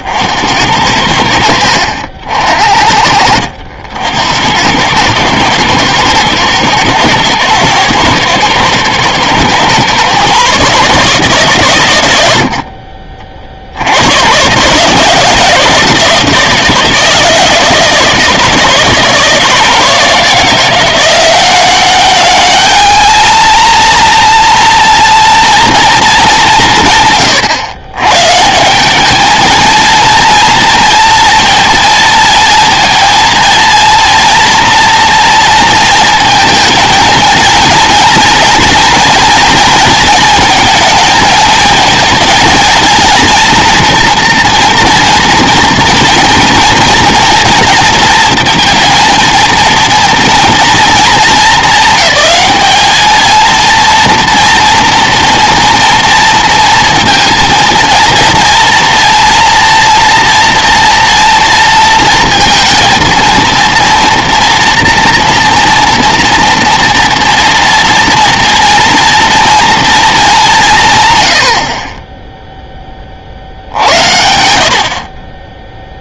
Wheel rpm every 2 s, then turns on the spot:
70, 60, 90, 110, 120, 140, 70, 120, 160, 160, 170, 210, 230, 200, 150, 230, 220, 240, 230, 240, 220, 220, 240, 230, 230, 230, 200, 230, 230, 230, 230, 230, 230, 230, 240, 200, 0, 70.
none